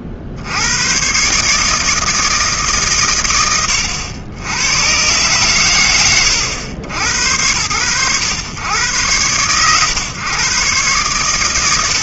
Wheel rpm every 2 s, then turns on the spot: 80, 150, 80, 70, 100, 110.
none